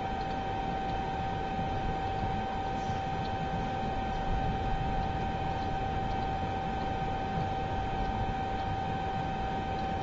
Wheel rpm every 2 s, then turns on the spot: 0, 0, 0, 0, 0.
none